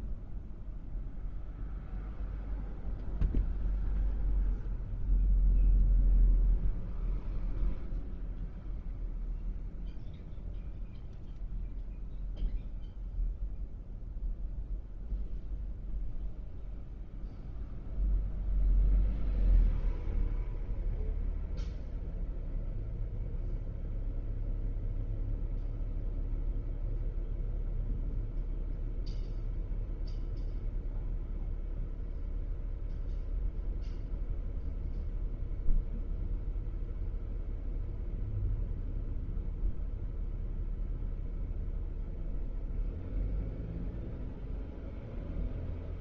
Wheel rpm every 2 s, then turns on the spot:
0, 0, 0, 0, 0, 0, 0, 0, 0, 0, 0, 0, 0, 0, 0, 0, 0, 0, 0, 0, 0, 0, 0.
none